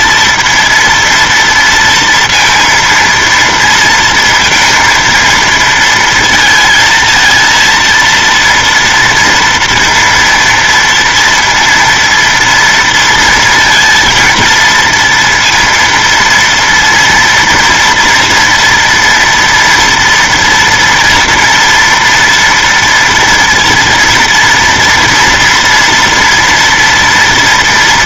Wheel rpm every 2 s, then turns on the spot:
230, 230, 230, 220, 230, 230, 230, 230, 230, 230, 230, 230, 230, 230.
none